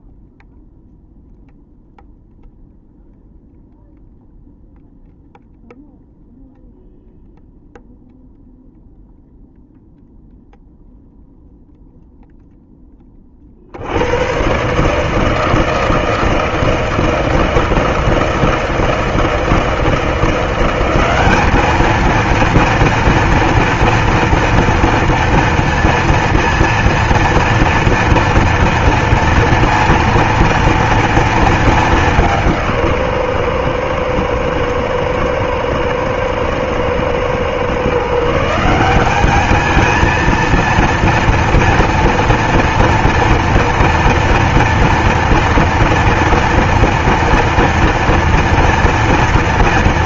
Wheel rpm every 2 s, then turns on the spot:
0, 0, 0, 0, 0, 0, 0, 130, 160, 160, 180, 230, 230, 230, 230, 230, 180, 110, 110, 160, 230, 230, 240, 230, 240.
none